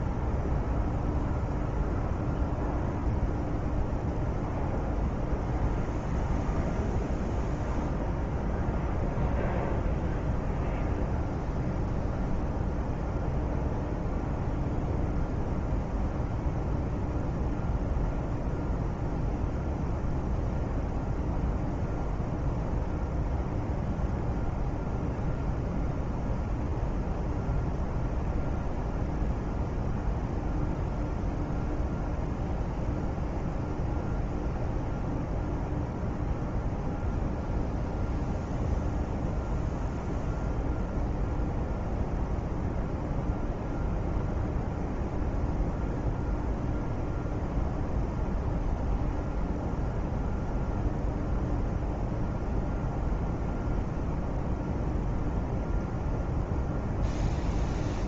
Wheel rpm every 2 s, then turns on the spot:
0, 0, 0, 0, 0, 0, 0, 0, 0, 0, 0, 0, 0, 0, 0, 0, 0, 0, 0, 0, 0, 0, 0, 0, 0, 0, 0, 0, 0.
none